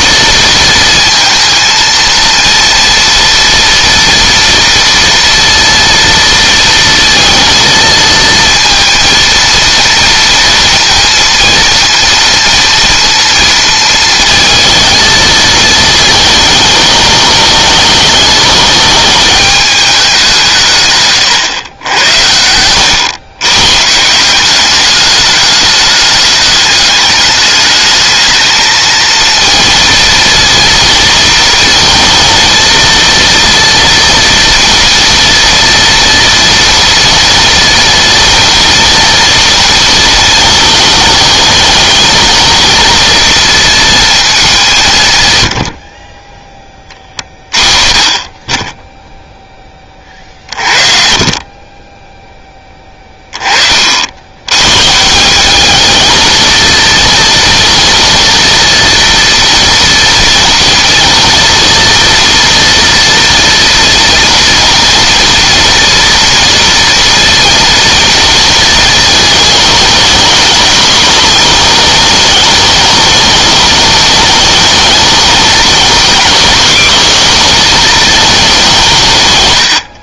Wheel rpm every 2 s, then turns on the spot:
230, 230, 230, 230, 230, 230, 230, 230, 210, 210, 160, 90, 190, 210, 220, 230, 230, 230, 230, 230, 220, 230, 200, 20, 10, 40, 10, 110, 230, 230, 230, 230, 230, 230, 230, 220, 210, 210, 210, 190.
none